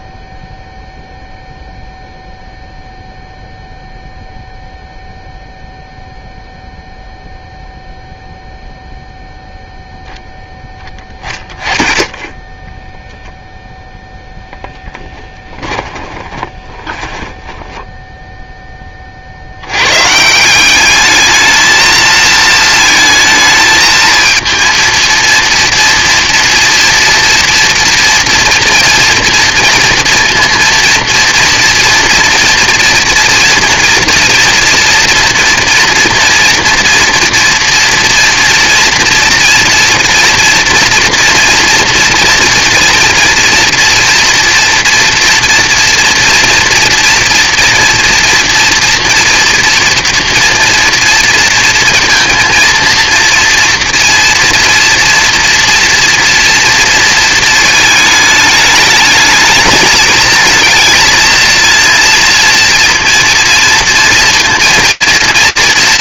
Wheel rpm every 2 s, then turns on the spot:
0, 0, 0, 0, 0, 10, 10, 0, 20, 20, 190, 220, 230, 230, 240, 230, 230, 230, 230, 230, 230, 230, 230, 230, 230, 230, 230, 230, 230, 210, 220, 230, 230.
12-14 16-18